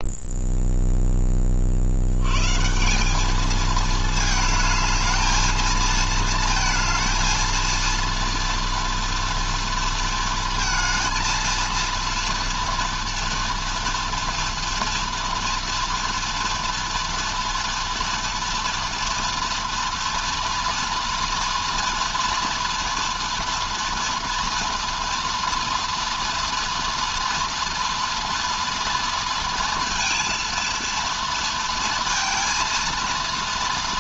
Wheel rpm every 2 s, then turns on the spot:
10, 190, 220, 230, 230, 220, 230, 230, 230, 230, 230, 230, 230, 240, 230, 230, 230.
none